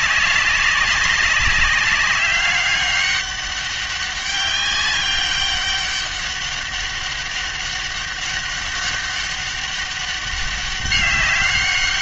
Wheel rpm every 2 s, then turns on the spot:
200, 200, 200, 200, 200, 200.
none